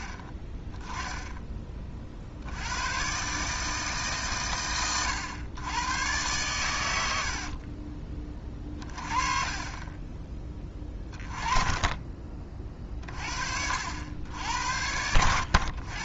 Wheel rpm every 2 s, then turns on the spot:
10, 120, 110, 80, 30, 20, 30, 90.
8-10